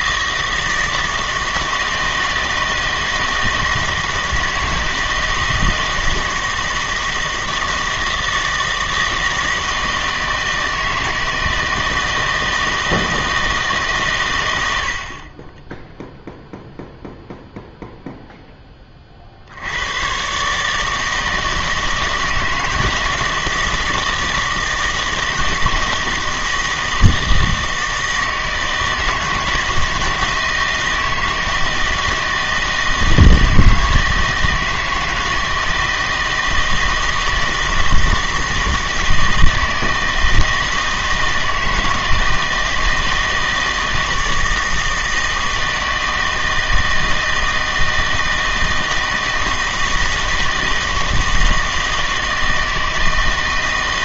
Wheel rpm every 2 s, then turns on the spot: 160, 160, 160, 160, 160, 160, 160, 80, 0, 20, 150, 160, 160, 160, 160, 160, 160, 160, 160, 160, 160, 160, 160, 160, 160, 160, 160.
none